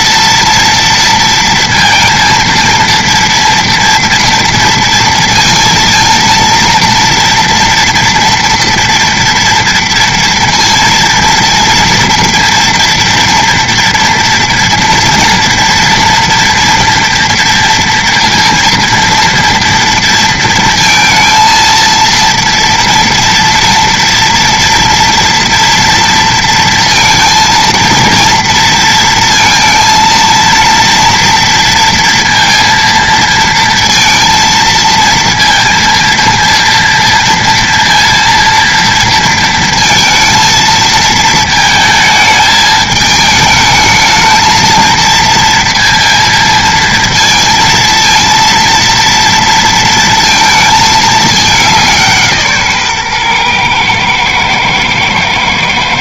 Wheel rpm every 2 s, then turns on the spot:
230, 230, 230, 230, 230, 230, 230, 240, 230, 230, 230, 230, 230, 230, 230, 230, 230, 230, 230, 230, 220, 210, 220, 230, 230, 220, 140, 110.
none